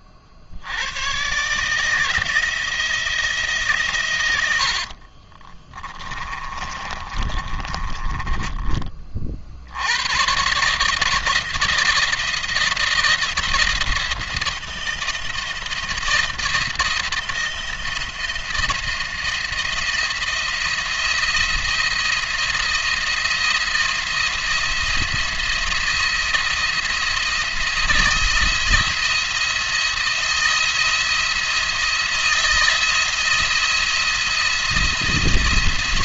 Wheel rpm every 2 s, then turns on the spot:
70, 160, 80, 40, 30, 140, 170, 160, 170, 170, 170, 170, 170, 170, 170, 170, 170, 170.
4-8